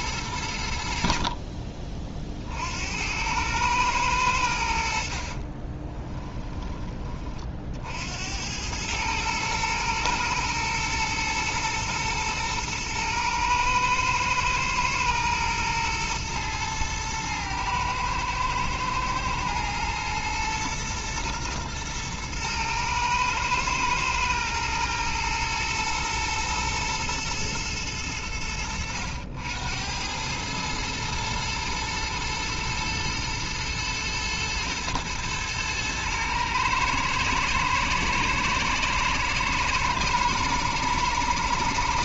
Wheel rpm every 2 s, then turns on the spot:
70, 80, 50, 20, 110, 120, 110, 110, 110, 120, 110, 110, 110, 110, 90, 110, 110, 110, 110, 120, 120.
4-6